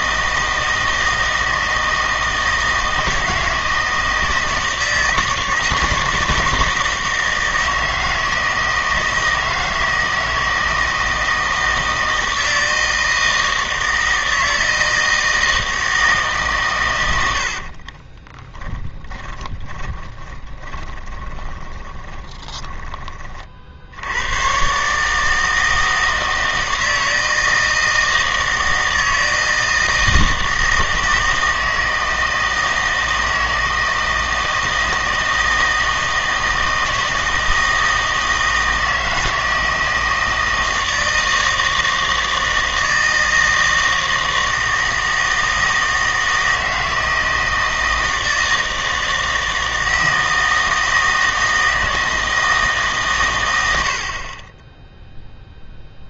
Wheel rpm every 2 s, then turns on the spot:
160, 160, 160, 160, 160, 160, 160, 160, 130, 10, 20, 20, 120, 160, 160, 160, 160, 160, 160, 160, 160, 160, 160, 160, 160, 160, 160, 20.
18-24